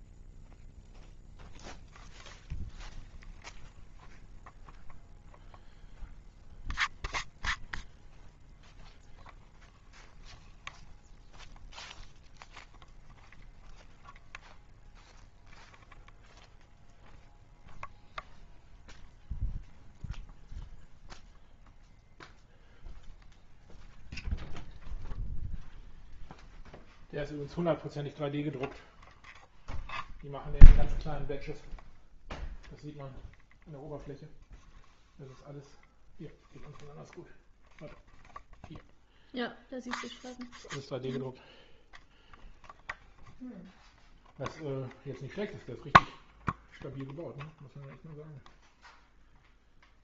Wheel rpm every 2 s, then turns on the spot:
0, 0, 0, 0, 0, 0, 0, 0, 0, 0, 0, 0, 0, 0, 0, 0, 0, 0, 0, 0, 0, 0, 0, 0, 0.
none